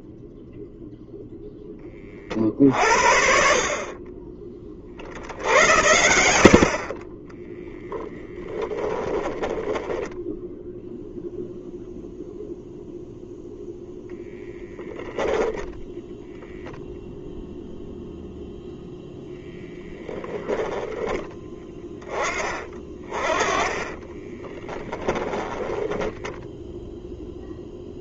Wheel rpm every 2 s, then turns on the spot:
0, 50, 40, 20, 20, 0, 0, 10, 0, 0, 10, 30, 20, 0.
6-10 20-22 24-26